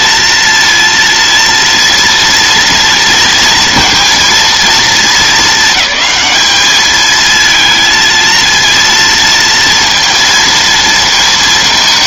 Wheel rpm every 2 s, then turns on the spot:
230, 230, 220, 220, 230, 230.
none